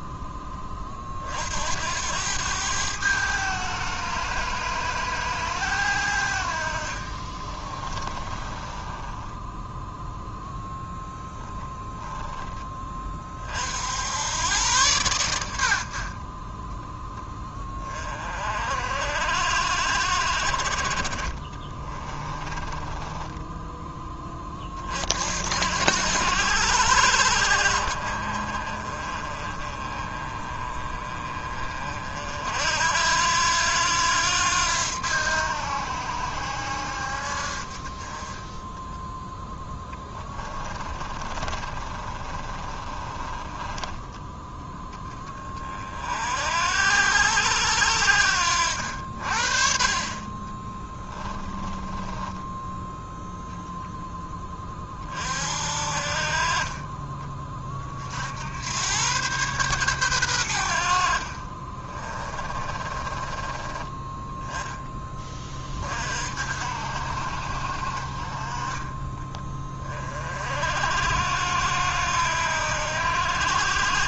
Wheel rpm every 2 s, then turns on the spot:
30, 100, 110, 50, 10, 10, 30, 110, 10, 60, 40, 20, 50, 70, 30, 30, 70, 80, 70, 10, 30, 30, 10, 70, 60, 10, 0, 30, 20, 110, 60, 20, 10, 60, 30, 60, 70.
6-10 22-24 40-44 50-52 62-64